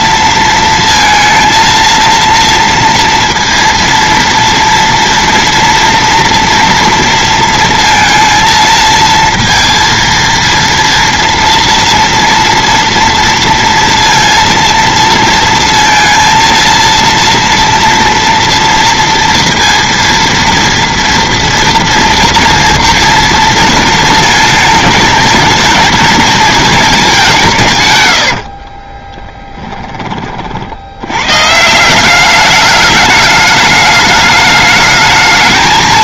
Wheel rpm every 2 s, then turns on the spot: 230, 230, 230, 240, 230, 230, 240, 230, 230, 230, 230, 240, 220, 220, 40, 70, 210, 210.
28-30